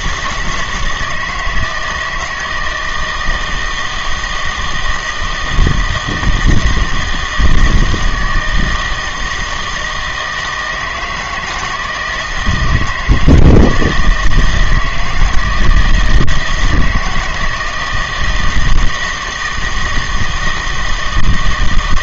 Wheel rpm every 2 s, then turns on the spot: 160, 160, 160, 160, 160, 160, 170, 160, 160, 160, 160.
none